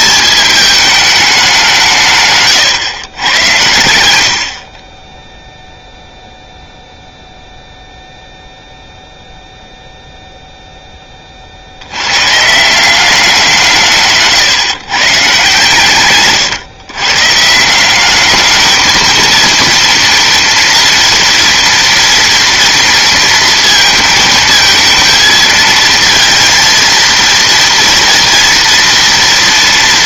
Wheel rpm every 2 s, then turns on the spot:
220, 110, 20, 0, 0, 10, 180, 140, 140, 220, 240, 230, 220, 230, 230.
none